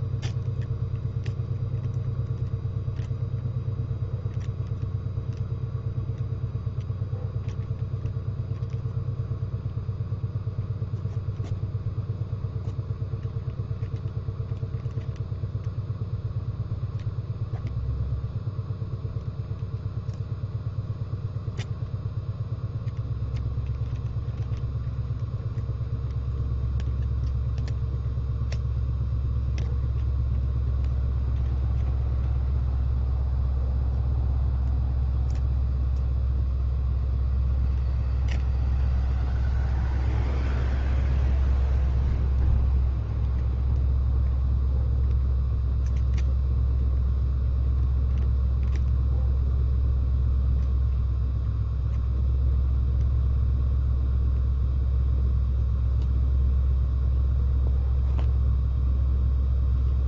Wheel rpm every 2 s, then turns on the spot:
0, 0, 0, 0, 0, 0, 0, 0, 0, 0, 0, 0, 0, 0, 0, 0, 0, 0, 0, 0, 0, 0, 0, 0, 0, 0, 0, 0, 0, 0.
none